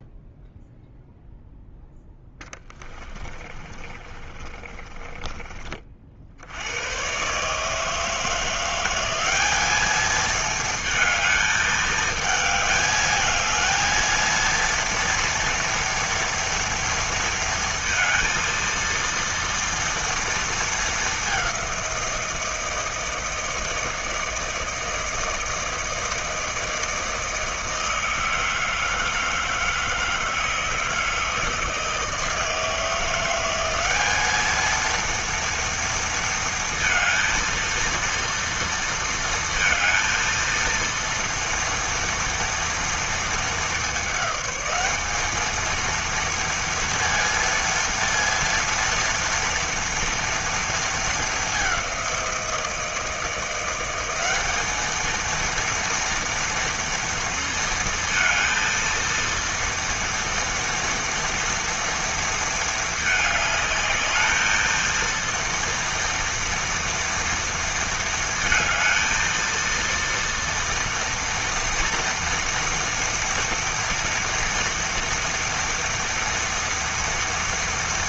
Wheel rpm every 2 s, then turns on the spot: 0, 20, 30, 110, 190, 220, 220, 230, 230, 230, 210, 160, 160, 160, 160, 160, 170, 230, 230, 230, 230, 230, 210, 230, 230, 220, 160, 220, 230, 230, 230, 220, 230, 230, 220, 230, 230, 230, 230.
2-6